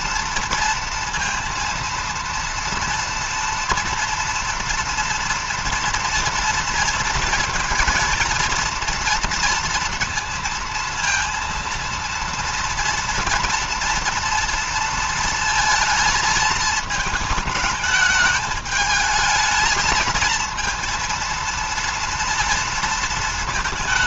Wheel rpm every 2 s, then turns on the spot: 230, 230, 230, 230, 230, 230, 230, 230, 220, 220, 230, 230.
none